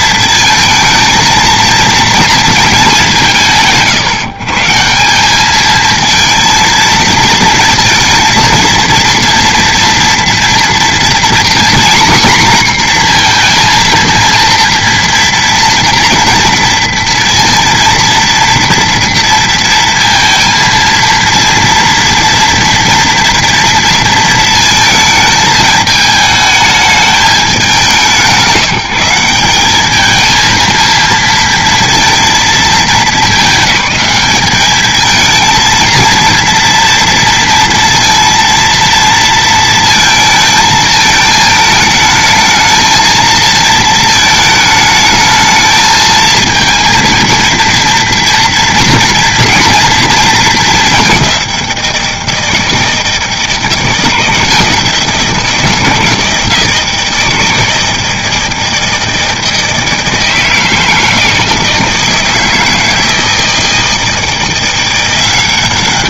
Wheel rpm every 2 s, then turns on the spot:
230, 230, 120, 220, 230, 230, 240, 240, 230, 230, 230, 230, 220, 210, 170, 230, 200, 220, 230, 230, 220, 220, 220, 230, 230, 200, 160, 170, 160, 160, 160, 160, 180.
none